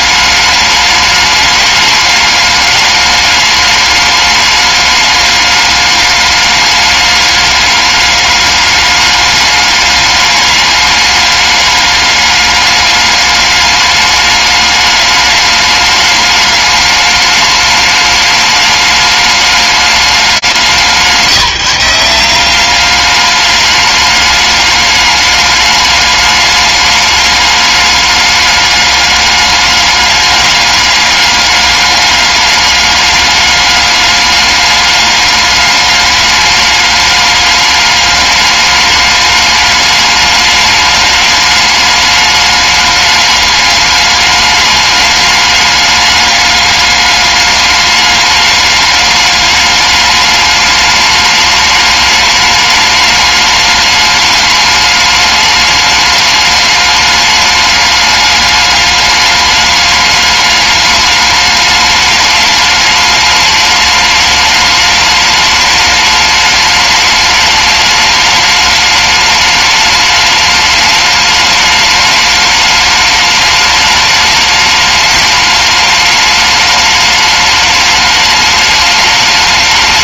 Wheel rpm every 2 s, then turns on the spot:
210, 210, 210, 210, 210, 210, 200, 210, 210, 210, 180, 190, 210, 210, 210, 200, 200, 200, 210, 210, 210, 210, 210, 210, 210, 210, 210, 210, 210, 210, 210, 210, 210, 210, 210, 210, 210, 210, 210, 210.
none